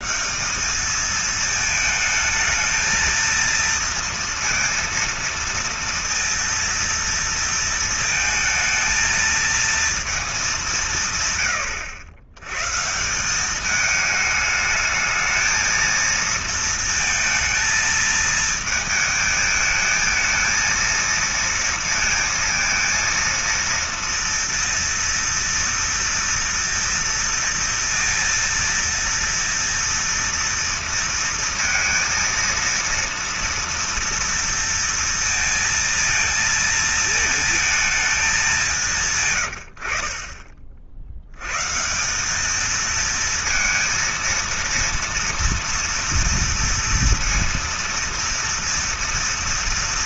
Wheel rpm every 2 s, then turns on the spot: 150, 220, 230, 230, 220, 220, 110, 210, 220, 220, 220, 230, 230, 230, 230, 230, 230, 230, 230, 210, 50, 190, 230, 230, 230.
none